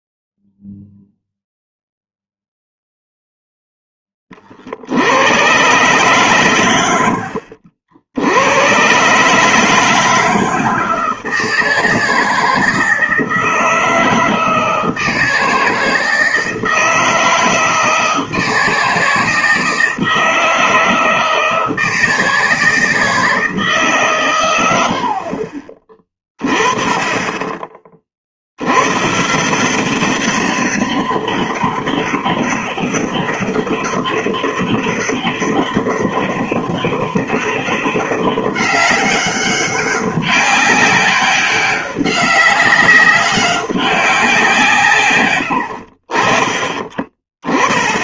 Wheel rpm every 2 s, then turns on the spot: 0, 0, 50, 120, 100, 160, 160, 160, 160, 160, 160, 160, 100, 20, 80, 200, 200, 200, 200, 200, 200, 200, 170, 30.
none